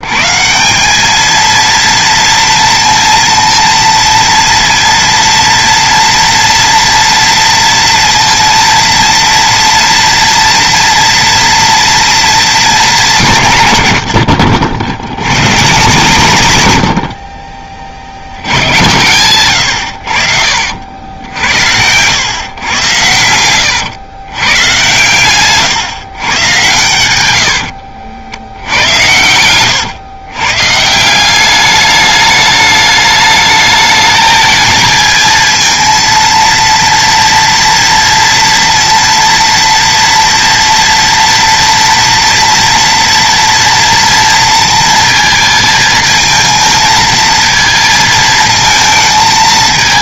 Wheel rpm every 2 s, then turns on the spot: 130, 230, 230, 230, 230, 230, 230, 90, 120, 70, 60, 110, 110, 140, 80, 130, 210, 220, 230, 230, 240, 240, 230, 230, 220.
none